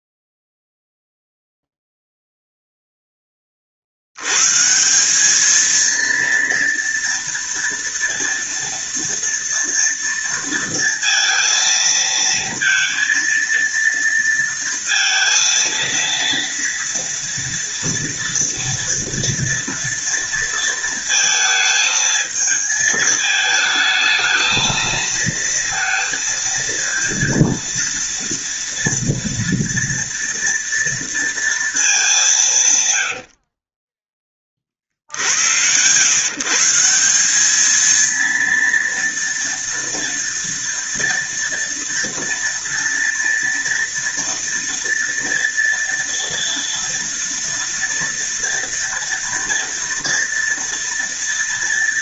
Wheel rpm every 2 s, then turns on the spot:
0, 0, 90, 230, 230, 230, 230, 230, 230, 230, 230, 220, 220, 230, 230, 230, 190, 30, 140, 230, 230, 230, 230, 230, 230, 230.
none